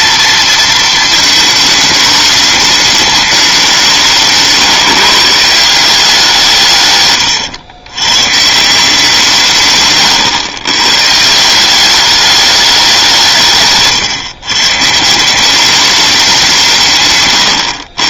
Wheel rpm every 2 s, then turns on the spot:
230, 210, 140, 150, 160, 120, 200, 140, 160.
none